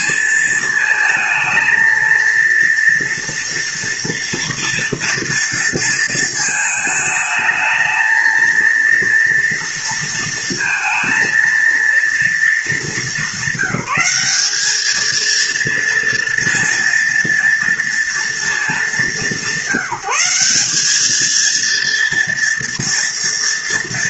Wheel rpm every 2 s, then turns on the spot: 220, 230, 230, 220, 230, 230, 210, 210, 230, 190, 200, 230.
none